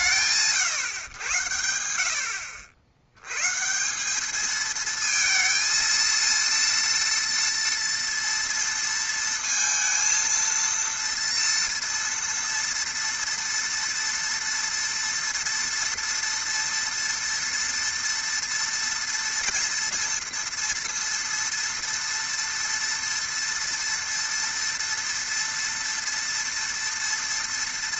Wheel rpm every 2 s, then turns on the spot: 80, 230, 230, 230, 230, 230, 230, 230, 230, 230, 230, 230, 230, 230.
none